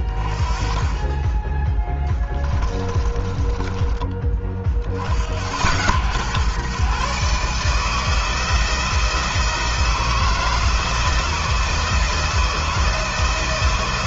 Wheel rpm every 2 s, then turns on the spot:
30, 20, 60, 130, 170, 160, 160.
2-4